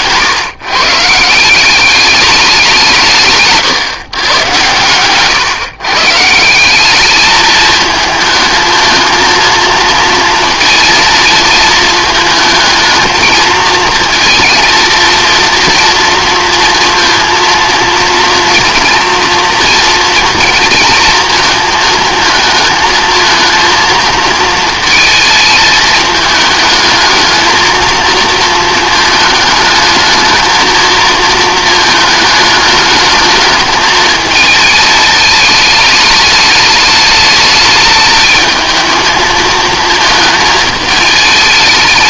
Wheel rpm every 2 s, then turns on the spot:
180, 140, 140, 210, 230, 220, 220, 230, 230, 230, 230, 230, 220, 220, 220, 230, 220, 210, 220, 220, 220.
none